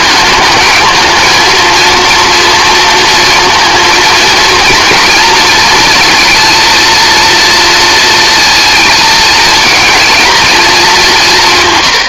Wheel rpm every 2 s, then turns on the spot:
220, 230, 230, 230, 230, 200.
none